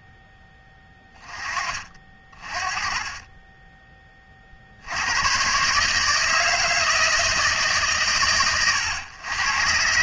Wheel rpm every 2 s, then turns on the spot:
10, 30, 120, 160, 110.
none